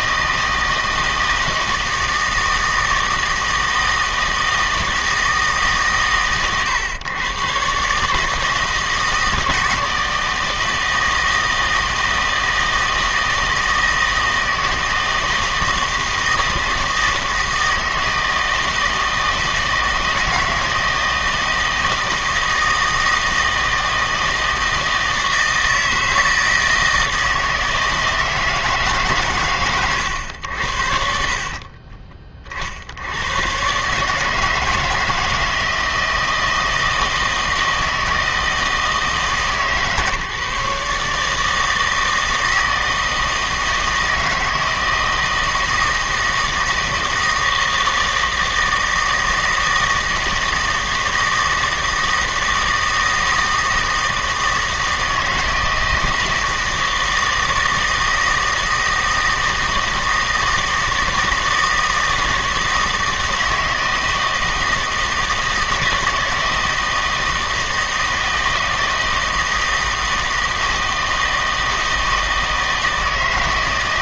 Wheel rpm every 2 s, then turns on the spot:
160, 160, 160, 120, 160, 160, 160, 160, 160, 160, 160, 160, 160, 160, 150, 80, 50, 160, 160, 160, 140, 160, 160, 160, 160, 160, 160, 160, 160, 160, 160, 160, 160, 160, 160, 160, 160.
none